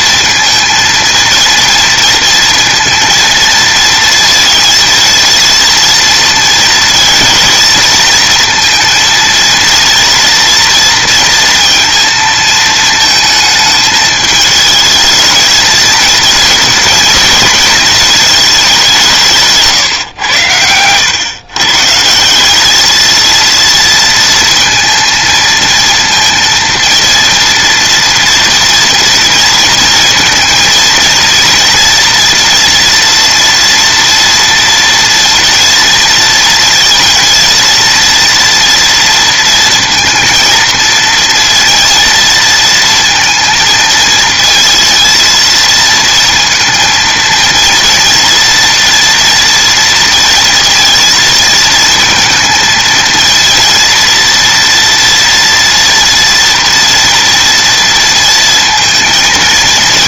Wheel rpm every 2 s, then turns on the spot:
230, 230, 230, 230, 230, 230, 220, 220, 220, 180, 100, 220, 230, 230, 230, 230, 230, 230, 230, 230, 230, 230, 220, 230, 230, 230, 230, 230, 230, 230.
none